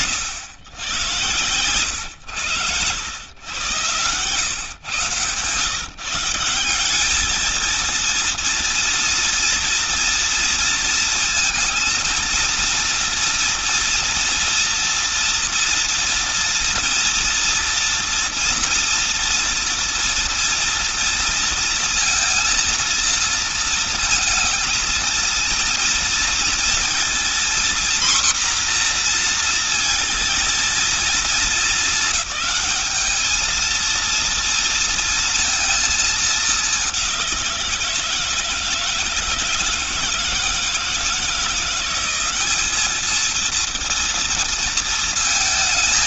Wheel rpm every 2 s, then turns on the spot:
110, 110, 120, 180, 230, 230, 230, 240, 230, 230, 230, 230, 230, 230, 240, 230, 220, 230, 200, 170, 160, 210, 230.
none